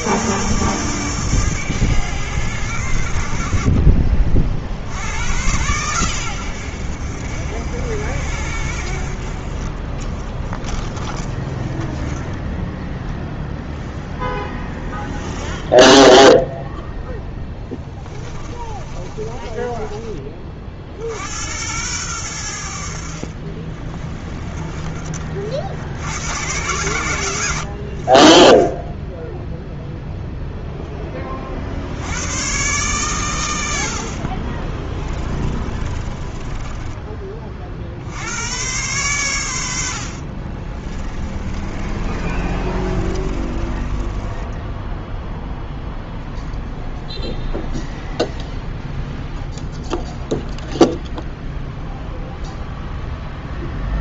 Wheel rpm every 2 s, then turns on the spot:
100, 90, 60, 80, 60, 10, 10, 0, 0, 20, 40, 80, 20, 110, 10, 0, 120, 30, 20, 110, 30, 30, 10, 0, 0, 0, 0.
18-20 24-26 34-38 40-44